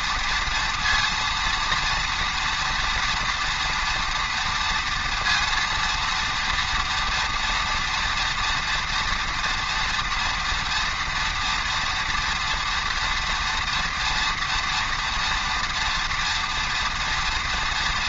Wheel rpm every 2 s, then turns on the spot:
230, 230, 230, 230, 230, 240, 230, 230, 230.
none